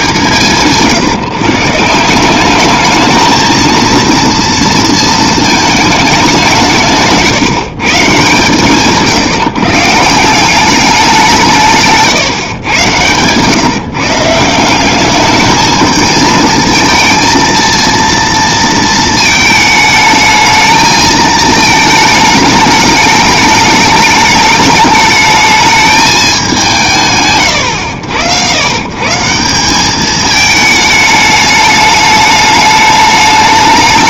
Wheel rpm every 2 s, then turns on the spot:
160, 200, 230, 170, 150, 190, 130, 170, 220, 230, 220, 210, 210, 180, 110, 220, 210.
none